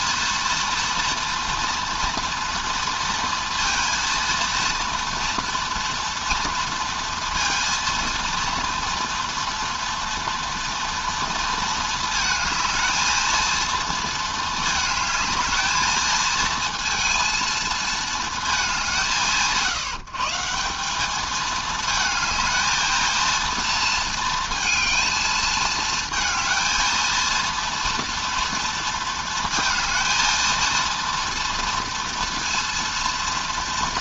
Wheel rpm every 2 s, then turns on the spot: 230, 230, 230, 230, 230, 230, 220, 220, 230, 190, 170, 230, 230, 220, 230, 230, 230.
none